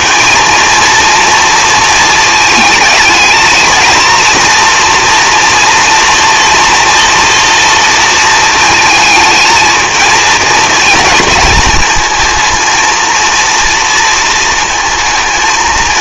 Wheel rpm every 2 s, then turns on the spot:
230, 220, 230, 230, 220, 230, 230, 220.
none